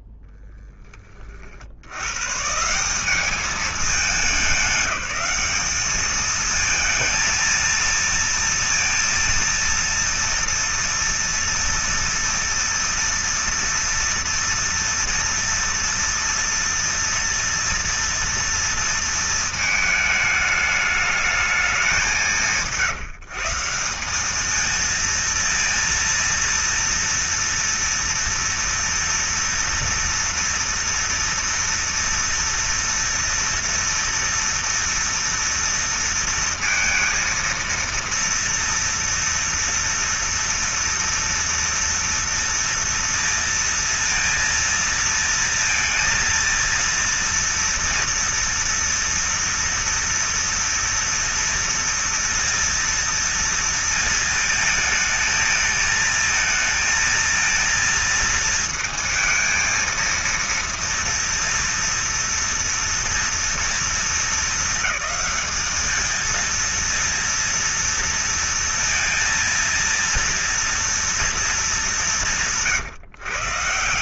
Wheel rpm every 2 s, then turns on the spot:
0, 130, 200, 210, 230, 240, 230, 230, 230, 230, 220, 190, 200, 230, 230, 230, 230, 230, 230, 230, 230, 230, 230, 230, 230, 230, 230, 230, 220, 230, 230, 230, 220, 220, 230, 230, 190.
none